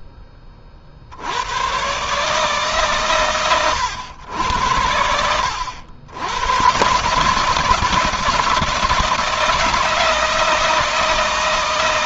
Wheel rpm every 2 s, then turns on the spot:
60, 130, 80, 130, 160, 160.
none